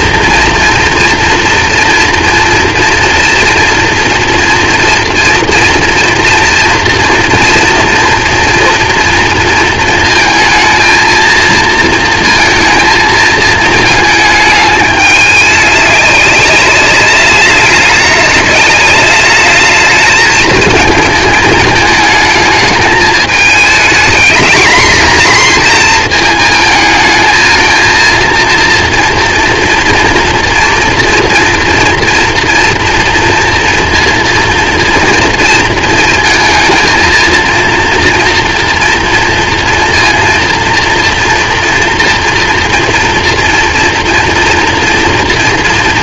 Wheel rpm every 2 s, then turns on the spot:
230, 230, 230, 230, 230, 220, 230, 220, 200, 200, 220, 220, 230, 230, 230, 230, 230, 230, 230, 230, 230, 230, 230.
none